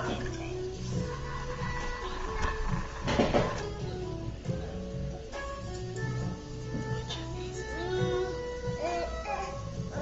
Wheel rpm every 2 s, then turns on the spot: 10, 20, 0, 0, 0.
2-4